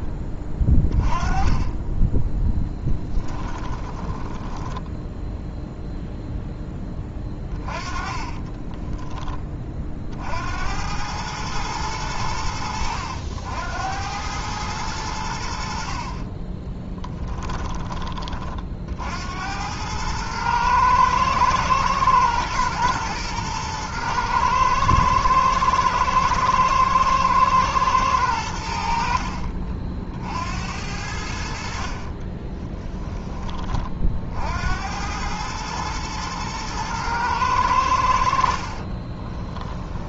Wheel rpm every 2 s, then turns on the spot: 20, 10, 10, 10, 20, 90, 80, 100, 10, 50, 110, 110, 110, 110, 80, 70, 10, 80, 110, 40.
2-6 8-10 16-18 32-34 38-40